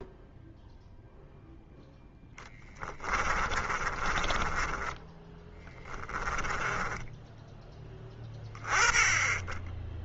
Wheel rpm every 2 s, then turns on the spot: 0, 20, 10, 10, 20.
2-8